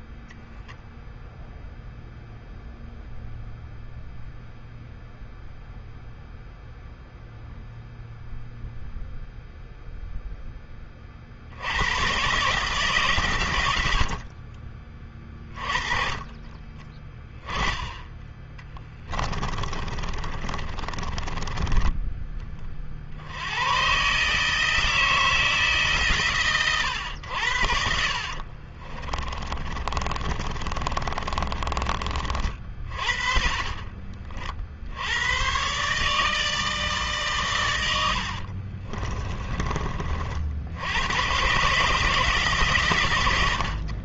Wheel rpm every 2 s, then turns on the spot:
0, 0, 0, 0, 0, 10, 140, 50, 20, 10, 30, 30, 150, 110, 40, 30, 40, 60, 150, 60, 70, 150.
18-22 28-32 38-40